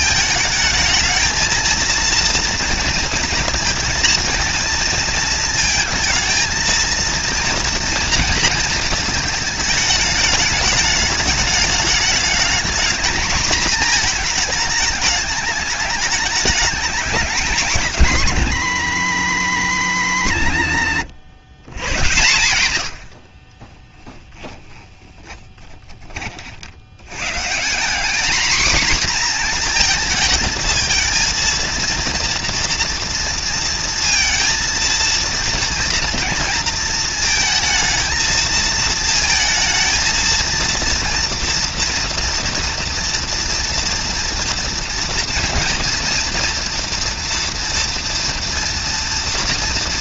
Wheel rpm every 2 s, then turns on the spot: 220, 230, 230, 230, 220, 210, 220, 210, 200, 150, 100, 100, 10, 70, 240, 220, 230, 230, 230, 220, 230, 230, 230, 230, 230.
20-22 24-26